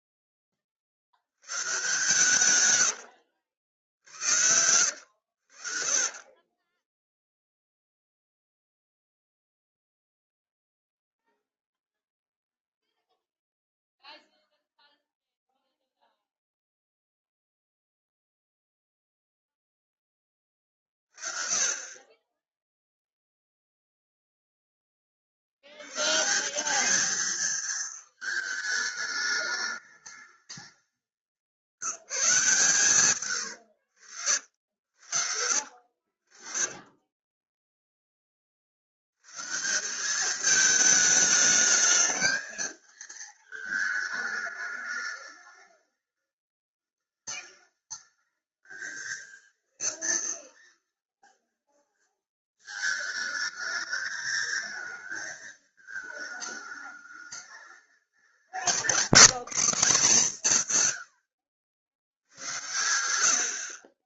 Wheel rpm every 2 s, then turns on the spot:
40, 130, 90, 20, 0, 20, 20, 20, 20, 20, 40, 10, 10, 190, 220, 200, 150, 70, 40, 60, 210, 220, 210, 210, 220, 230, 220, 230, 220, 190, 150, 90.
10-20 36-38